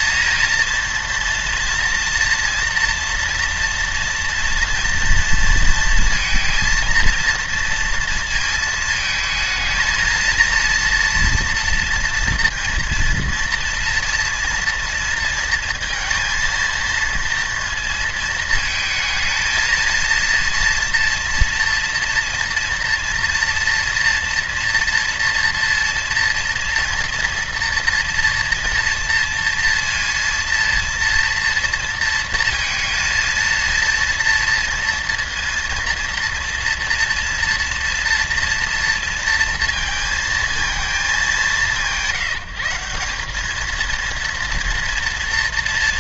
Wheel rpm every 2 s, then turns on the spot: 230, 240, 230, 230, 230, 230, 230, 230, 230, 230, 240, 240, 240, 240, 230, 230, 230, 230, 230, 230, 220, 190, 230.
none